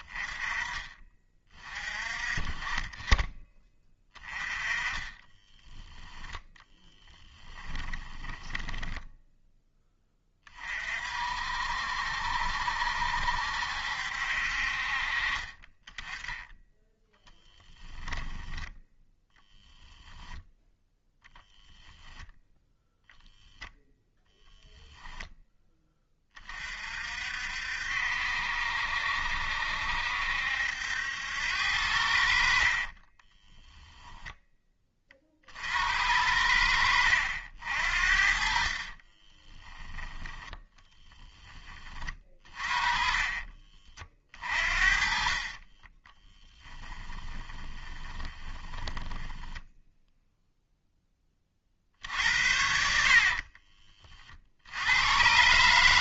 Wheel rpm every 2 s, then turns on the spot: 20, 20, 20, 10, 10, 40, 70, 50, 10, 0, 0, 0, 0, 50, 70, 70, 40, 20, 70, 40, 10, 30, 40, 10, 20, 0, 70, 80.
6-10 32-34 38-40 42-50 52-54